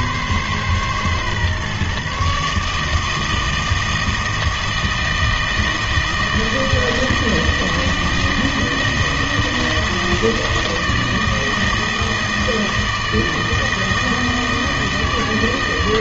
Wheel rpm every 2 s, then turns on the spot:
130, 150, 160, 160, 160, 160, 160, 160.
none